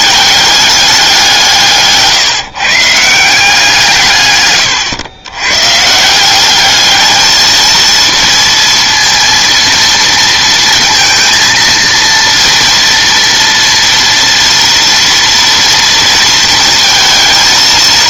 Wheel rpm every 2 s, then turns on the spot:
200, 150, 120, 210, 230, 230, 230, 230, 230.
none